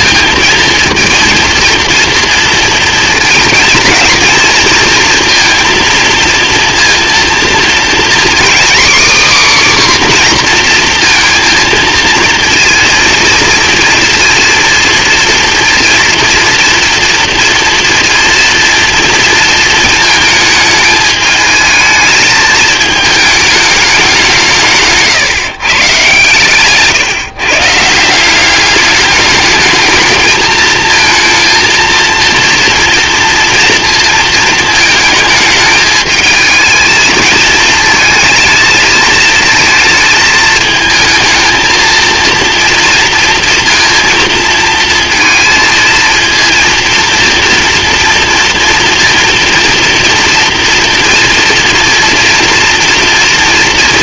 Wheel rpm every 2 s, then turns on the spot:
230, 230, 230, 230, 270, 240, 230, 230, 230, 230, 220, 220, 150, 130, 200, 220, 230, 230, 220, 220, 220, 230, 230, 230, 240, 230, 230.
none